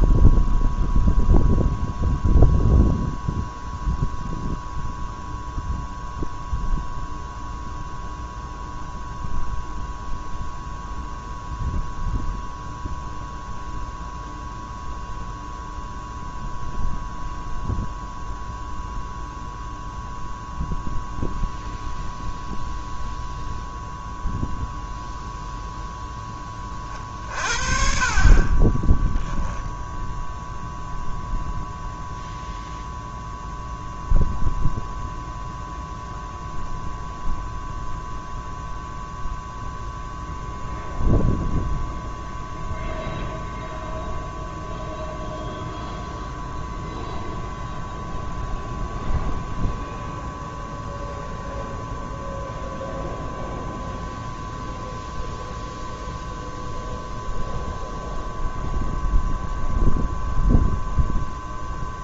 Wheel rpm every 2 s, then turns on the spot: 0, 0, 0, 0, 0, 0, 0, 0, 0, 0, 0, 0, 0, 30, 10, 0, 0, 0, 0, 0, 0, 0, 0, 0, 0, 0, 0, 0, 0, 0, 0.
28-30